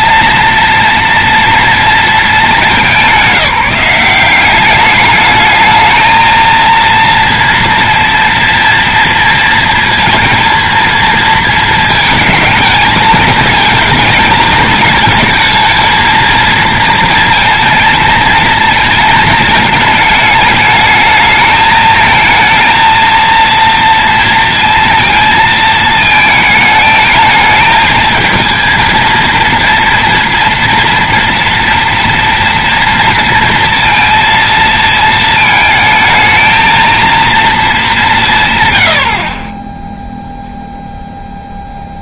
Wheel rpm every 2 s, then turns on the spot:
230, 190, 190, 230, 230, 230, 220, 220, 230, 220, 210, 220, 230, 220, 230, 240, 230, 230, 230, 130, 0.
none